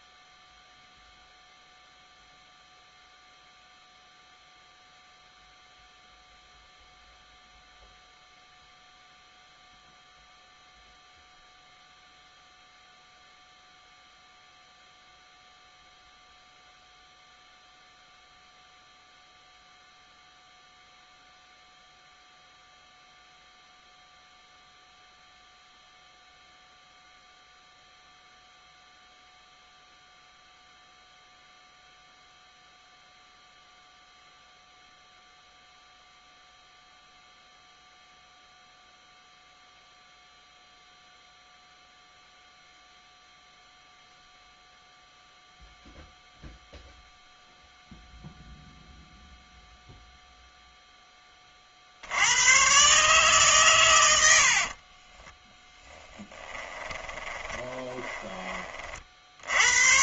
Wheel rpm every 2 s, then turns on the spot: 0, 0, 0, 0, 0, 0, 0, 0, 0, 0, 0, 0, 0, 0, 0, 0, 0, 0, 0, 0, 0, 0, 0, 0, 0, 0, 110, 70, 20, 30.
54-58